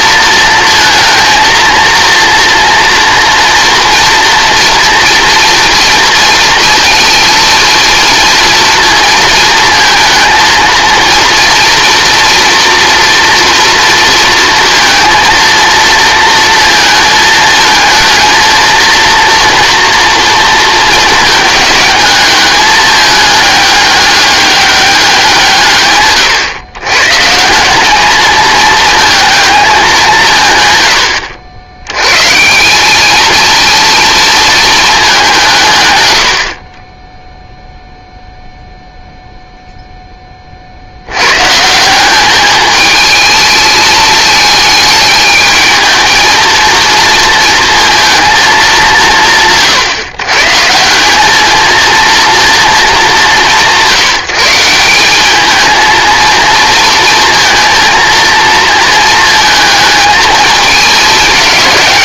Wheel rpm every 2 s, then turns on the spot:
230, 230, 230, 230, 230, 230, 230, 230, 220, 230, 230, 210, 200, 120, 220, 110, 190, 210, 30, 0, 70, 220, 220, 230, 200, 170, 220, 170, 230, 230, 210.
none